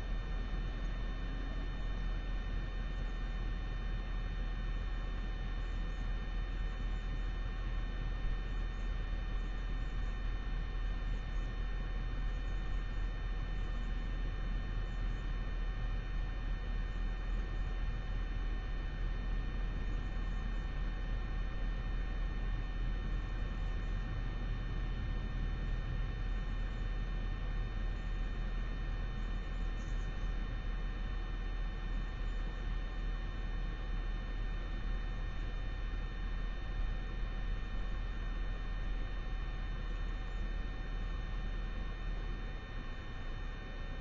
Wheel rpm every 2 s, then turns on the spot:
0, 0, 0, 0, 0, 0, 0, 0, 0, 0, 0, 0, 0, 0, 0, 0, 0, 0, 0, 0, 0, 0.
none